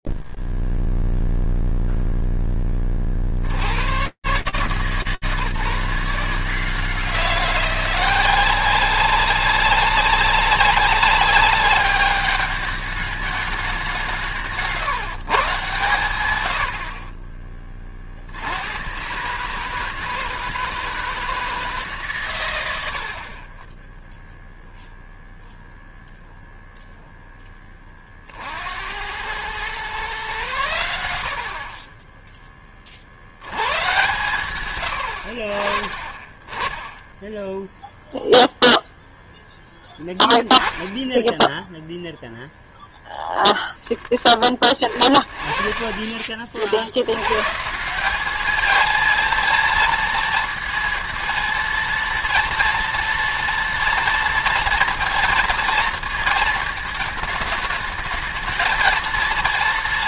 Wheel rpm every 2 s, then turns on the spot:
0, 0, 100, 170, 180, 190, 200, 180, 120, 70, 160, 100, 0, 0, 80, 100, 40, 120, 20, 0, 10, 0, 30, 60, 220, 230, 240, 230, 220, 220.
none